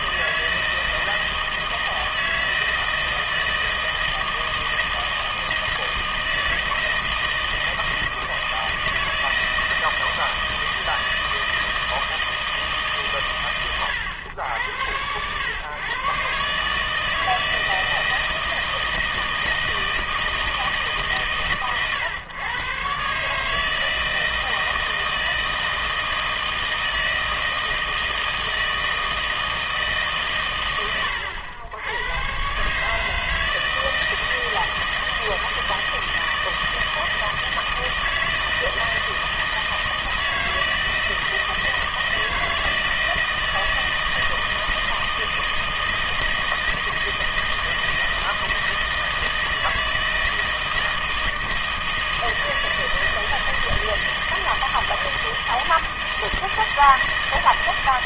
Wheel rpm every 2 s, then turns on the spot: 160, 160, 160, 160, 160, 160, 150, 90, 150, 160, 150, 130, 160, 160, 160, 100, 150, 160, 160, 160, 160, 160, 160, 160, 160, 160, 160, 160, 160.
none